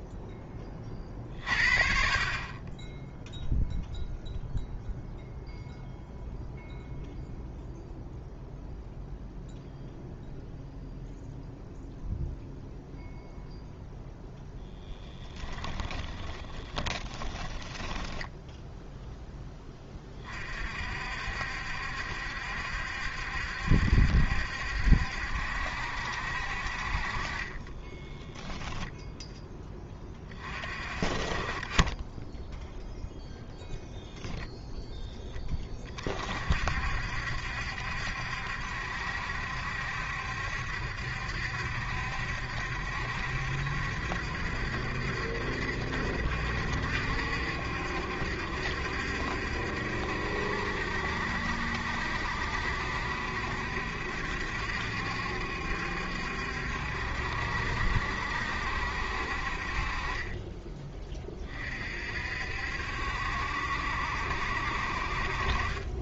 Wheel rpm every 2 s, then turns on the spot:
30, 10, 0, 0, 0, 0, 0, 10, 20, 0, 50, 70, 70, 40, 10, 30, 0, 0, 60, 70, 70, 70, 70, 70, 70, 70, 70, 70, 70, 60, 20, 70, 50.
16-18 28-30